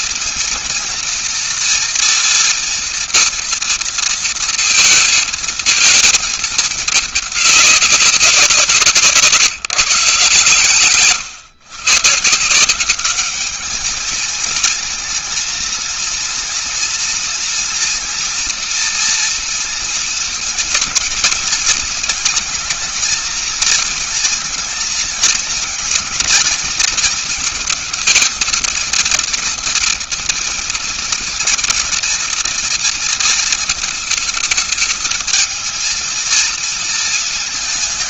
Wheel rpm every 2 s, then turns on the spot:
230, 230, 230, 210, 170, 130, 160, 220, 240, 230, 230, 220, 220, 220, 230, 240, 230, 220, 230.
10-12